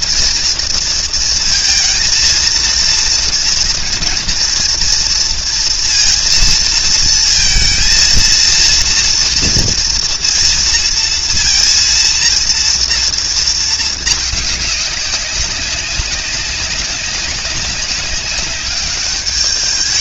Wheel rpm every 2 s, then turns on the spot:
230, 230, 230, 230, 230, 230, 230, 200, 190, 200.
none